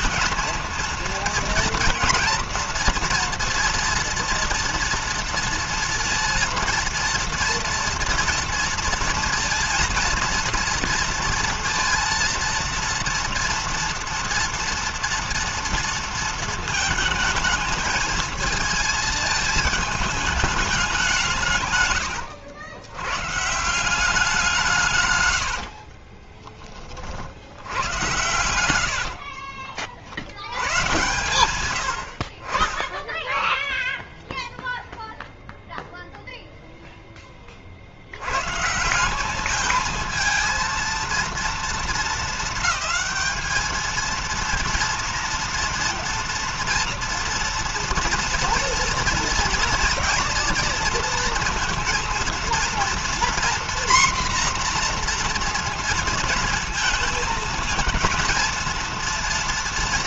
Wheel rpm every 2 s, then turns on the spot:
230, 230, 230, 230, 230, 230, 230, 230, 230, 220, 210, 90, 180, 30, 90, 90, 50, 0, 0, 110, 230, 220, 230, 230, 230, 230, 230, 240, 230, 230.
26-30